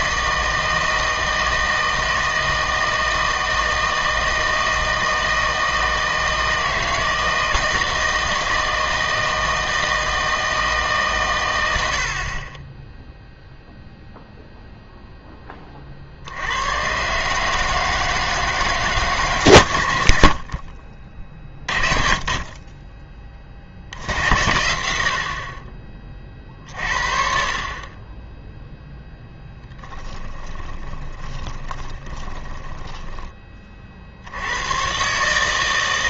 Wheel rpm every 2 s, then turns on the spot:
160, 160, 160, 160, 160, 150, 20, 0, 100, 150, 40, 20, 90, 50, 0, 20, 10, 110.
30-34